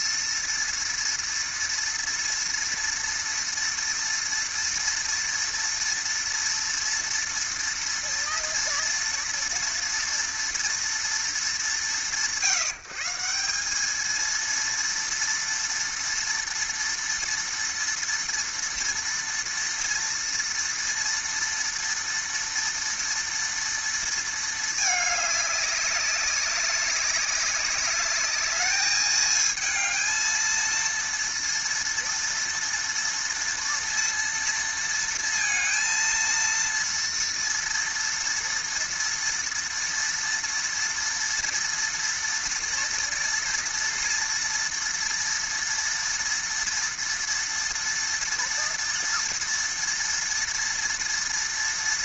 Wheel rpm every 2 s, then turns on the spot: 230, 230, 230, 230, 230, 230, 170, 210, 230, 230, 230, 230, 230, 200, 200, 220, 230, 230, 230, 230, 230, 230, 230, 230, 230, 230.
none